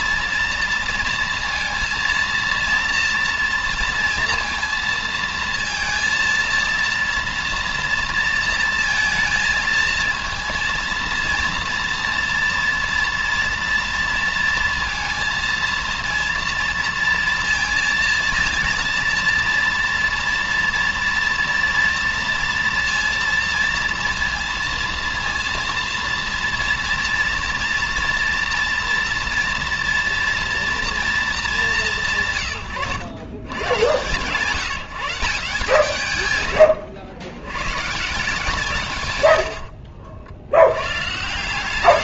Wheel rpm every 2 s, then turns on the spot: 230, 230, 230, 230, 230, 230, 230, 230, 230, 230, 230, 230, 230, 230, 230, 230, 150, 150, 120, 150, 70.
none